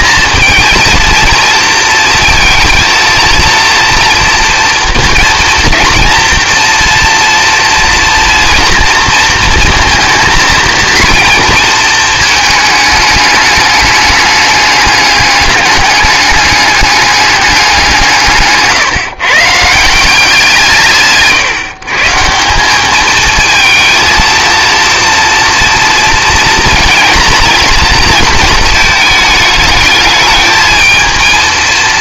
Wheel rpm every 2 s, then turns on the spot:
230, 230, 230, 240, 230, 230, 210, 210, 200, 150, 150, 210, 230, 230, 220, 220.
none